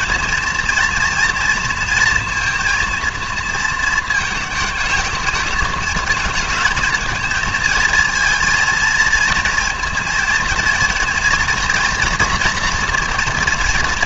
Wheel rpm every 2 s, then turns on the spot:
230, 230, 220, 220, 230, 230, 230.
none